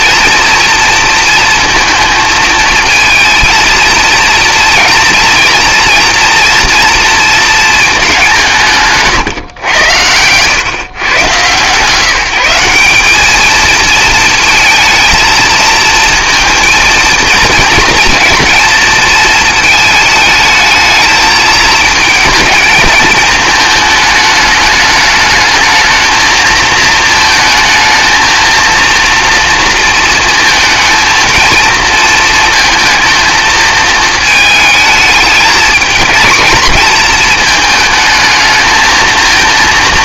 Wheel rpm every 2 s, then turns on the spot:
230, 220, 230, 230, 160, 120, 180, 220, 230, 220, 220, 220, 210, 220, 230, 230, 230, 220, 230, 220.
none